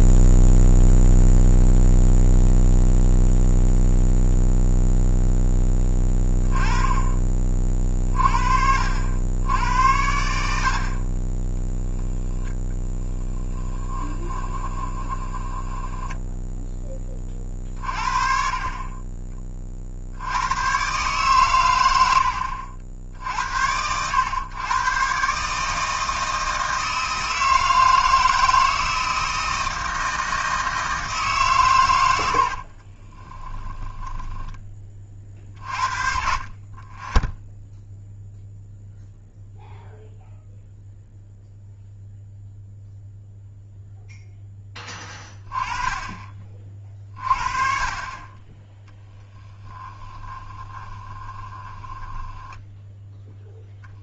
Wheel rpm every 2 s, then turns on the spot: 0, 0, 0, 20, 70, 50, 0, 20, 10, 40, 120, 70, 120, 160, 160, 160, 50, 20, 30, 0, 0, 0, 10, 40, 10, 20, 10.
14-16 32-34 50-54